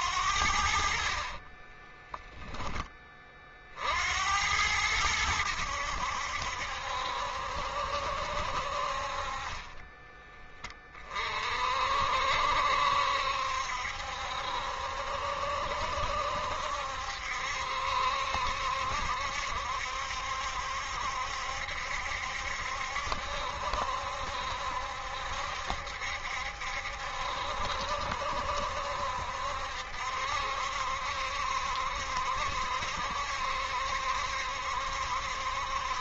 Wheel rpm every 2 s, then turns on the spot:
50, 10, 90, 70, 50, 30, 70, 70, 70, 70, 70, 70, 70, 70, 70, 70, 70, 70.
0-2